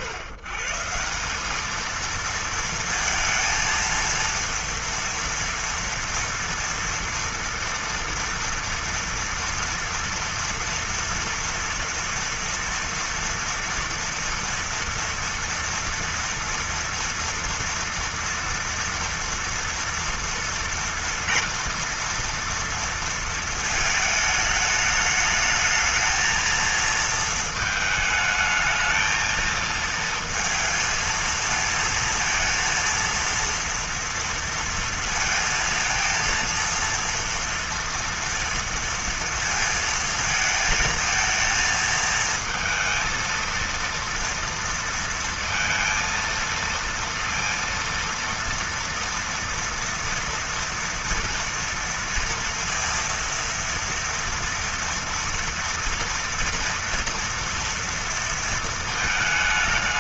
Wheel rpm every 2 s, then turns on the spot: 150, 230, 230, 230, 230, 230, 230, 230, 230, 240, 230, 230, 210, 230, 220, 230, 230, 230, 230, 230, 220, 230, 230, 230, 230, 230, 230, 230, 230, 230.
none